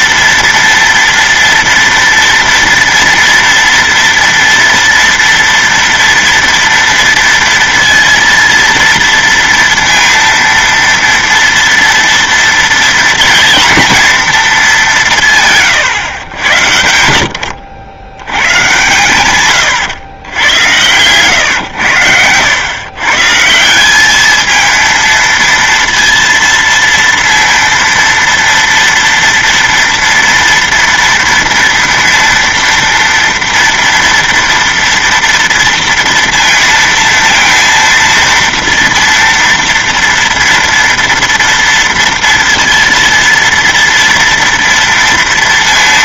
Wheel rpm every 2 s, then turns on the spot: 230, 230, 230, 230, 230, 230, 230, 210, 100, 110, 110, 100, 220, 230, 230, 230, 230, 230, 230, 230, 230, 230, 230.
none